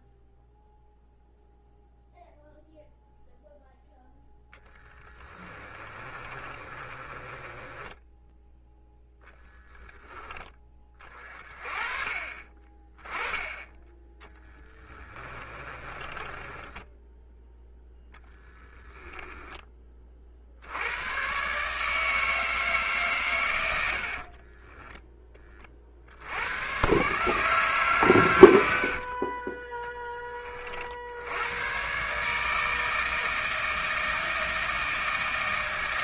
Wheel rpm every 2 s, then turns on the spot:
0, 0, 10, 30, 0, 30, 20, 20, 10, 10, 90, 160, 10, 120, 60, 60, 160, 160.
4-8 14-18 28-30